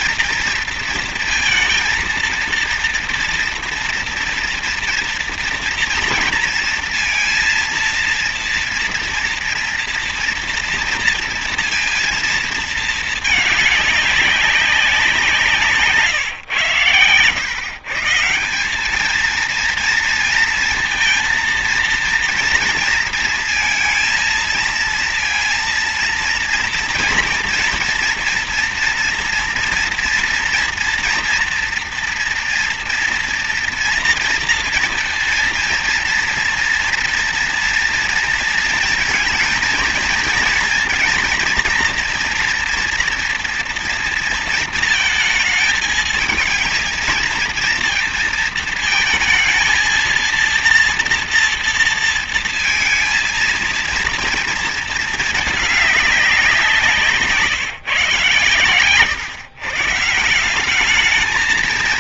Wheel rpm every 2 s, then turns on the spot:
230, 230, 230, 230, 230, 230, 230, 200, 120, 170, 230, 230, 230, 230, 240, 240, 230, 230, 230, 230, 230, 230, 230, 220, 230, 230, 230, 230, 180, 130, 180.
none